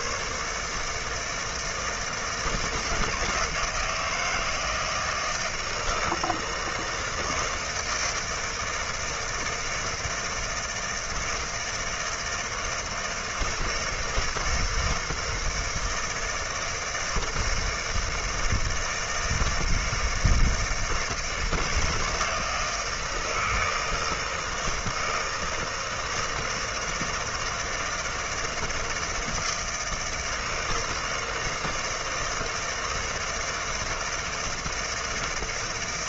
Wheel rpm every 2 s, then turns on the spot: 150, 160, 160, 160, 160, 160, 160, 160, 160, 160, 160, 160, 160, 160, 160, 160, 160, 160.
none